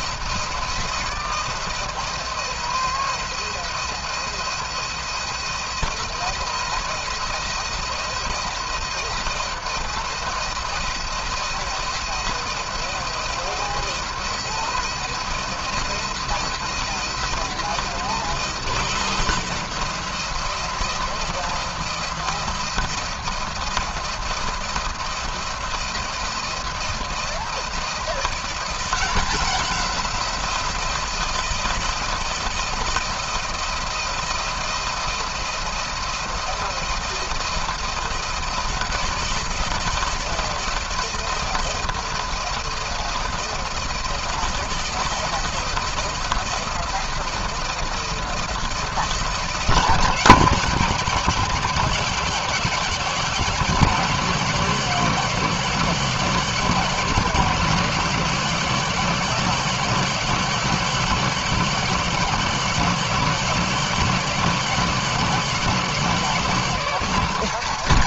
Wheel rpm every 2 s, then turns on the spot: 170, 170, 170, 170, 170, 170, 170, 170, 170, 170, 170, 170, 160, 170, 180, 180, 170, 170, 170, 170, 170, 170, 170, 170, 170, 160, 150, 150, 160, 160, 160, 160, 170, 160.
none